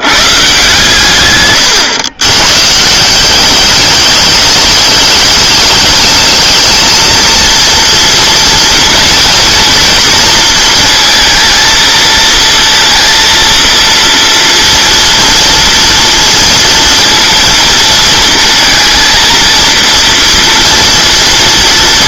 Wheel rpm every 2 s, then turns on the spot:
150, 140, 200, 220, 230, 230, 230, 230, 230, 230, 230.
none